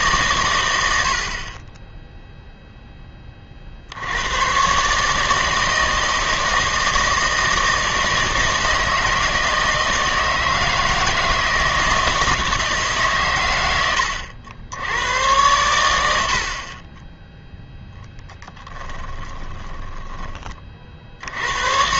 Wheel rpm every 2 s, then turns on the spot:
110, 0, 120, 160, 160, 160, 160, 80, 40, 10, 30.
18-20